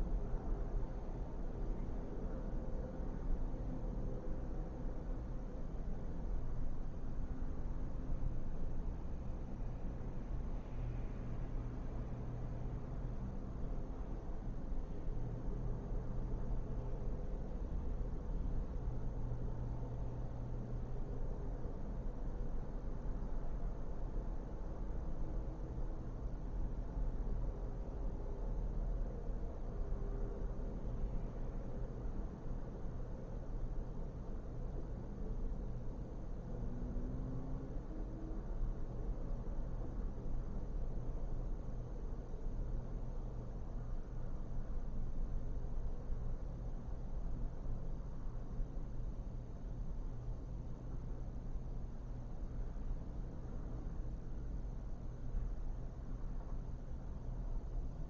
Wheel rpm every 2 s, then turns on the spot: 0, 0, 0, 0, 0, 0, 0, 0, 0, 0, 0, 0, 0, 0, 0, 0, 0, 0, 0, 0, 0, 0, 0, 0, 0, 0, 0, 0, 0.
none